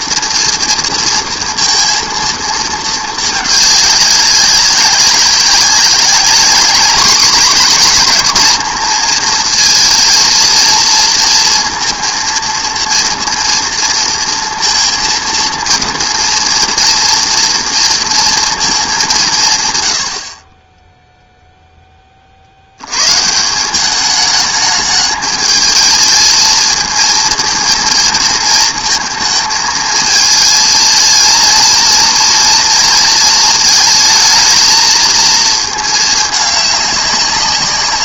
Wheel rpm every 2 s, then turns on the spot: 230, 230, 190, 200, 220, 230, 230, 230, 230, 230, 30, 70, 210, 220, 230, 220, 230, 220, 210.
none